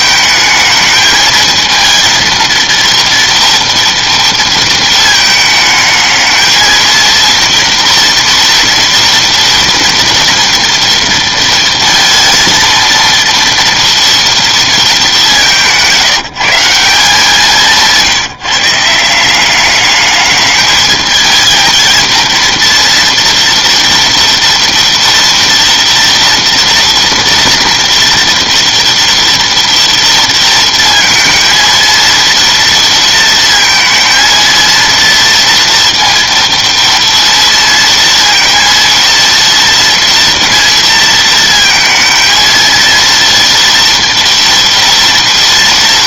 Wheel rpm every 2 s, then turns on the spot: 220, 230, 230, 220, 230, 230, 230, 220, 170, 160, 210, 230, 230, 230, 230, 230, 230, 230, 230, 230, 230, 230, 230.
none